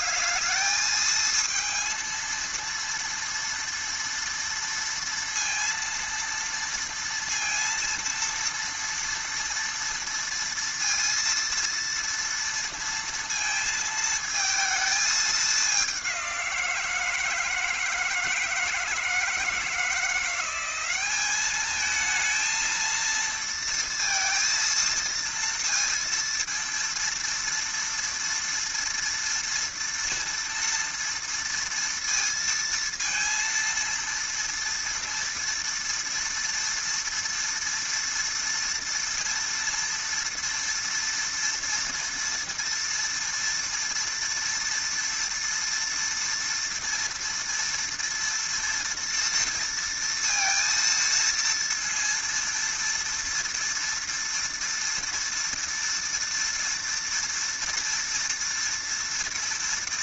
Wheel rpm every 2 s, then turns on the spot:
210, 230, 230, 230, 230, 230, 230, 220, 180, 160, 180, 230, 230, 230, 230, 230, 230, 230, 230, 230, 230, 230, 230, 230, 230, 230, 230, 230, 230, 230.
none